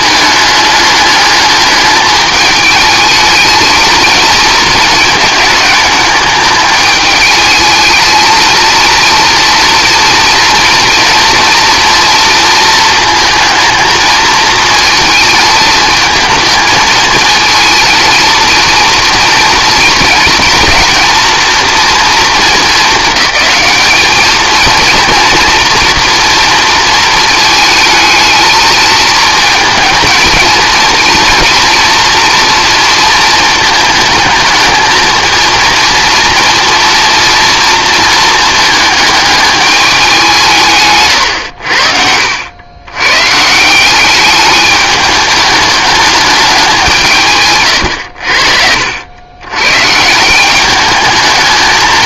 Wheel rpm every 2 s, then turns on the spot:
210, 210, 220, 210, 230, 230, 230, 220, 220, 230, 230, 200, 220, 230, 220, 220, 230, 220, 230, 220, 160, 100, 210, 190, 70, 200.
none